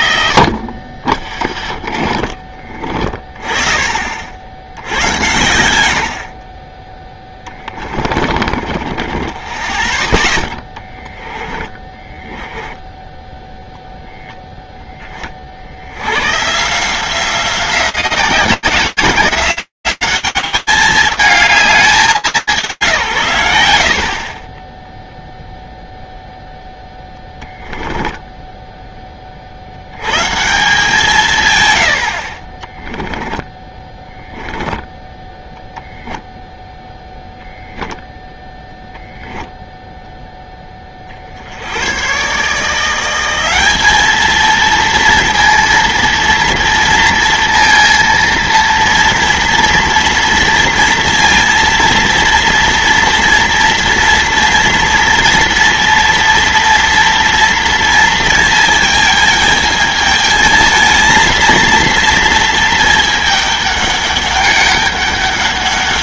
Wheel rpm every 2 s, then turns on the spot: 80, 20, 50, 80, 20, 10, 20, 10, 120, 180, 210, 150, 10, 0, 10, 150, 40, 10, 10, 20, 0, 120, 220, 230, 230, 230, 230, 230, 240, 220, 220, 230, 200.
2-4 8-10 12-14 32-38